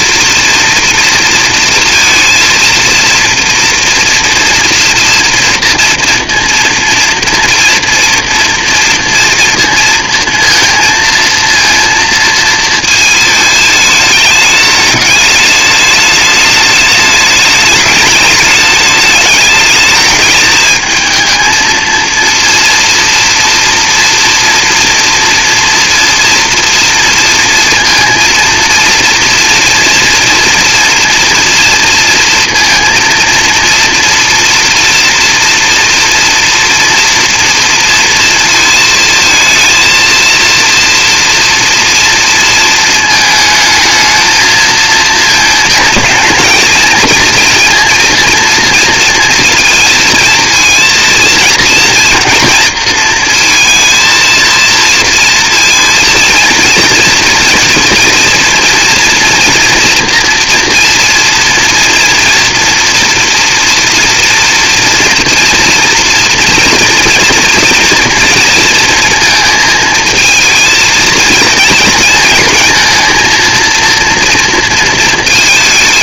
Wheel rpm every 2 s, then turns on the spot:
230, 230, 230, 230, 230, 230, 230, 210, 210, 210, 220, 230, 230, 230, 230, 240, 230, 230, 240, 230, 230, 230, 220, 220, 240, 230, 240, 230, 230, 230, 230, 230, 230, 230, 230, 230, 230, 230.
none